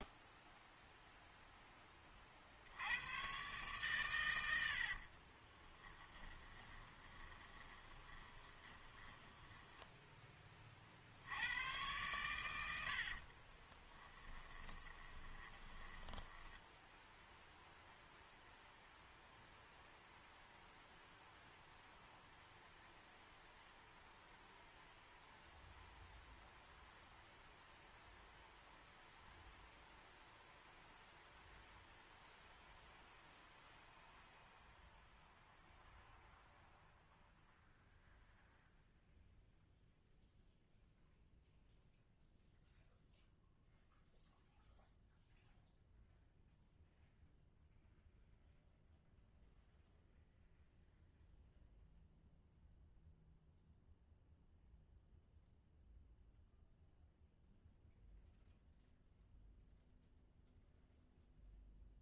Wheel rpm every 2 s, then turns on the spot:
0, 50, 100, 20, 20, 20, 120, 20, 10, 0, 0, 0, 0, 0, 0, 0, 0, 0, 0, 0, 0, 0, 0, 0, 0, 0, 0, 0, 0, 0, 0.
6-10 14-16